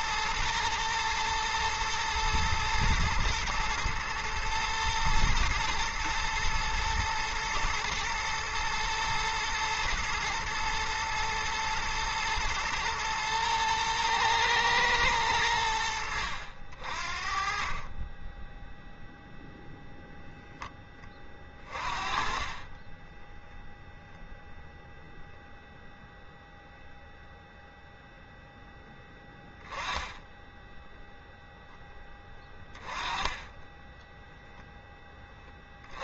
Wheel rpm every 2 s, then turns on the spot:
110, 120, 120, 110, 120, 110, 120, 110, 40, 0, 10, 20, 0, 0, 10, 0, 20, 10.
22-24